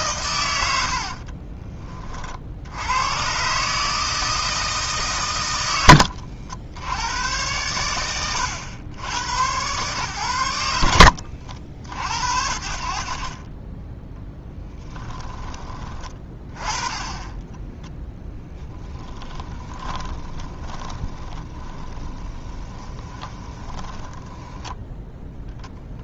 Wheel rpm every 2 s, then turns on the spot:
70, 90, 150, 80, 90, 70, 60, 10, 20, 20, 20, 20, 10.
14-16 18-26